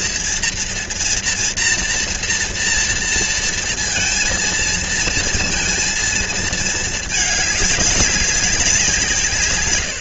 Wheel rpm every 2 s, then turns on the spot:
230, 230, 230, 210, 170.
none